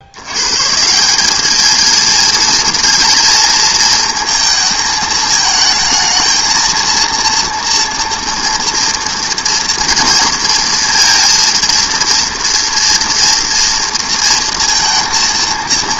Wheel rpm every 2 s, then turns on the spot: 140, 230, 220, 230, 230, 230, 230, 230.
none